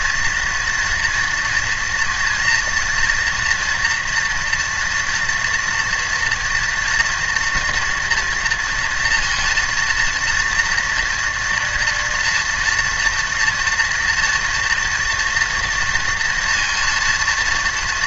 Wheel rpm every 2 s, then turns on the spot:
230, 230, 240, 240, 230, 230, 240, 230, 230.
none